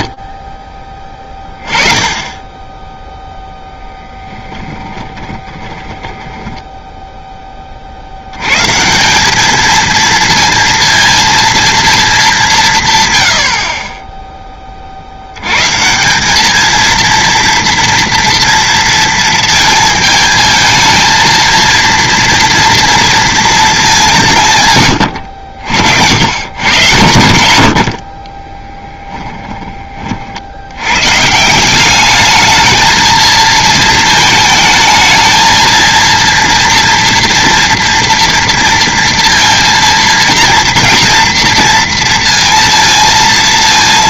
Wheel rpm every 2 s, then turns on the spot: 10, 0, 10, 10, 130, 230, 160, 30, 220, 230, 220, 230, 120, 120, 20, 90, 220, 220, 230, 230, 230, 230.
4-8 28-30